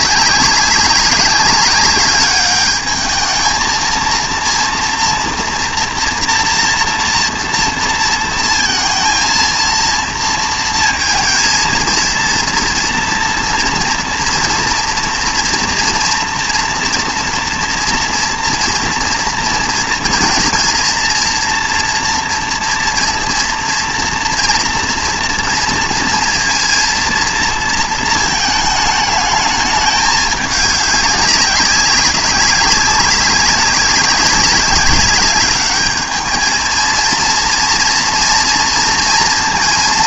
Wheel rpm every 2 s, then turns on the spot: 200, 210, 230, 230, 230, 230, 230, 240, 240, 230, 230, 230, 230, 230, 220, 200, 190, 190, 220, 230.
none